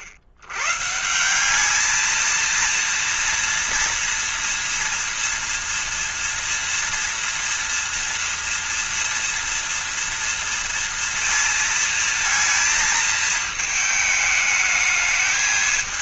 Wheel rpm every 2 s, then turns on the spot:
110, 230, 240, 240, 230, 230, 220, 210.
none